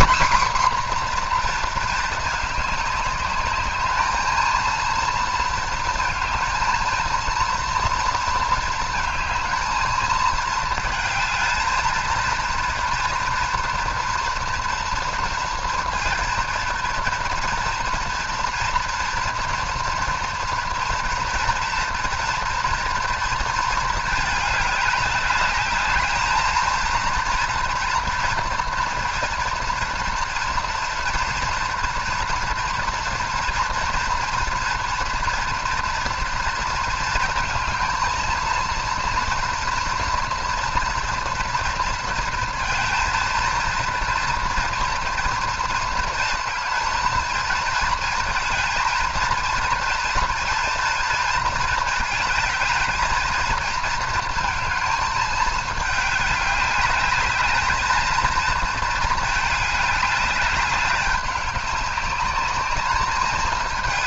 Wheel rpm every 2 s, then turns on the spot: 260, 210, 230, 230, 220, 220, 230, 230, 230, 240, 230, 230, 210, 230, 230, 230, 240, 230, 230, 230, 230, 230, 230, 230, 230, 230, 220, 220, 200, 220, 200, 210.
none